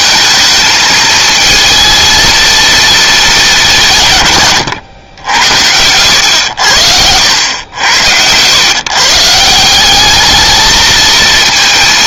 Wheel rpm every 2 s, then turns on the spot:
220, 230, 120, 90, 120, 220.
4-8